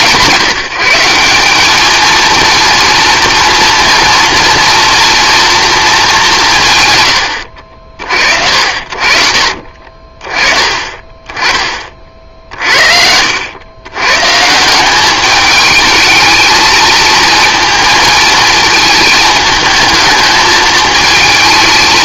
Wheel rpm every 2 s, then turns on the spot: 180, 230, 230, 120, 60, 30, 60, 180, 220, 220, 220.
12-14